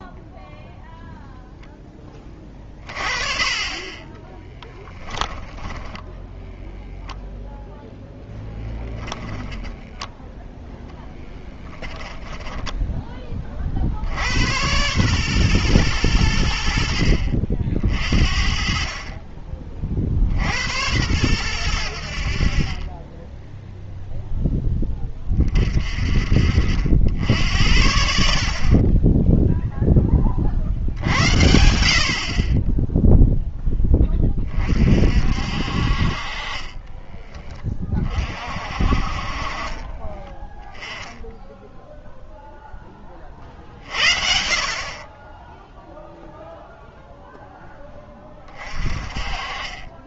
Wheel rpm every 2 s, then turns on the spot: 0, 30, 10, 10, 0, 0, 10, 120, 70, 50, 90, 40, 10, 50, 40, 60, 20, 30, 30, 40, 10, 0, 50, 0, 40.
4-6 12-14 36-38